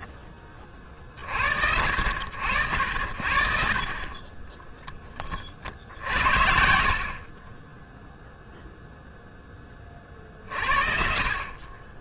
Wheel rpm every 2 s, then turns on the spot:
30, 70, 20, 40, 0, 50.
none